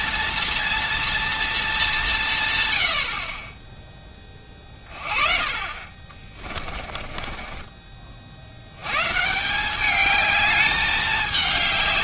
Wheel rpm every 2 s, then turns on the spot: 230, 110, 30, 30, 90, 210.
6-8